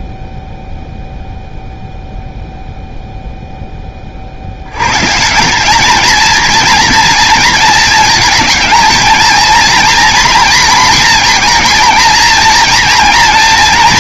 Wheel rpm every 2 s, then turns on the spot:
0, 0, 90, 230, 220, 230, 230.
none